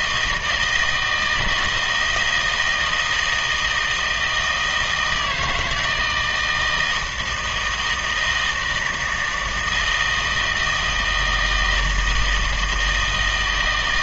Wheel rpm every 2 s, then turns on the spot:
160, 160, 160, 160, 160, 160, 160.
none